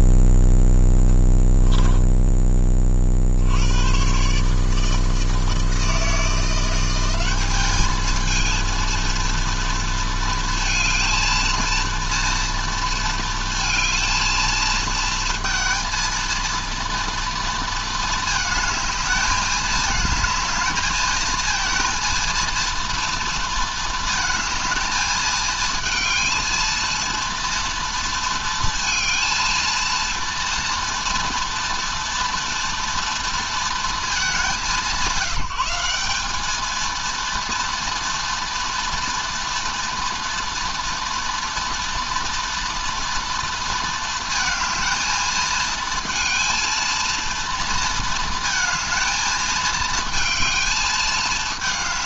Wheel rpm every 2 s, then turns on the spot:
0, 20, 150, 170, 220, 230, 230, 220, 230, 220, 220, 230, 220, 230, 230, 230, 230, 170, 210, 230, 230, 230, 220, 230, 220, 220.
none